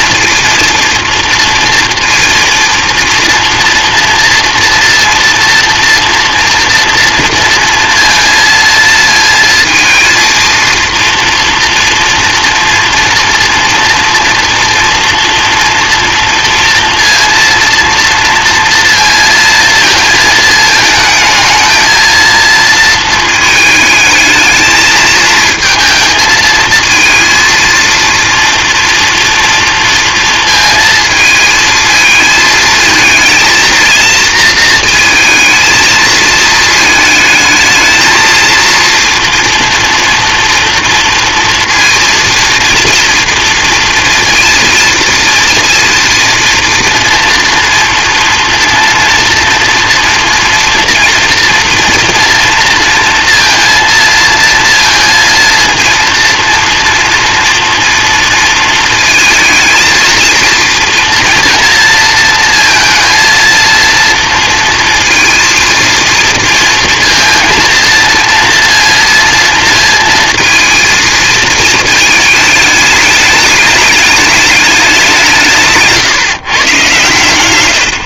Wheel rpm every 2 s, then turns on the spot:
230, 230, 230, 230, 230, 230, 230, 230, 230, 230, 220, 220, 220, 220, 230, 220, 230, 230, 220, 230, 230, 230, 230, 230, 230, 230, 230, 220, 230, 220, 230, 230, 230, 230, 230, 220, 210, 190, 140.
none